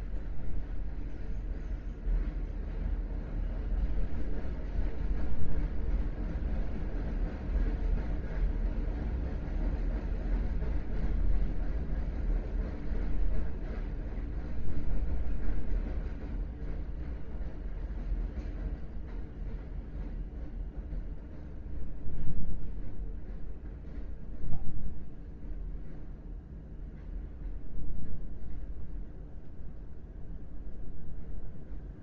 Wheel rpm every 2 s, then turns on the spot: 0, 0, 0, 0, 0, 0, 0, 0, 0, 0, 0, 0, 0, 0, 0, 0.
none